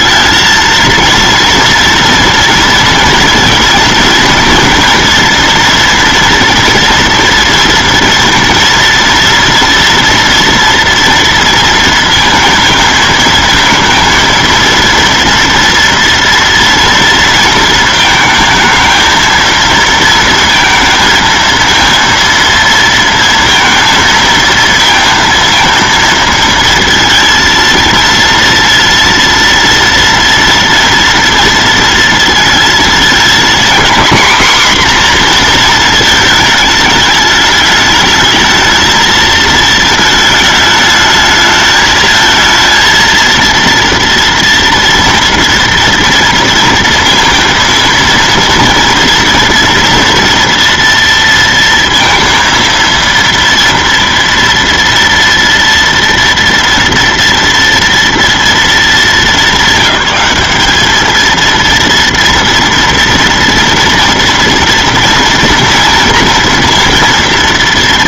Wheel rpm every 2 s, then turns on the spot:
230, 230, 230, 230, 230, 230, 220, 230, 230, 220, 230, 230, 230, 230, 230, 230, 220, 250, 220, 220, 210, 230, 230, 230, 230, 240, 230, 230, 230, 230, 210, 230, 230, 230.
none